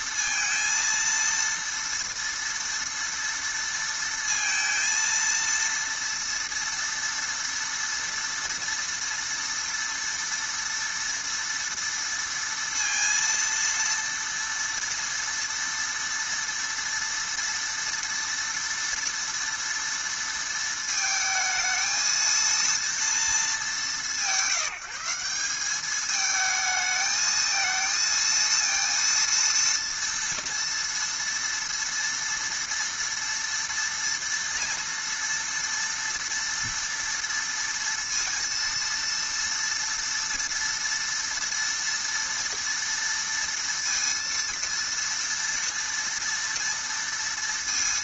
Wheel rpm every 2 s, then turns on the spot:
230, 230, 230, 230, 230, 230, 230, 230, 230, 230, 230, 230, 160, 220, 230, 230, 230, 230, 230, 230, 240, 230, 230, 230.
none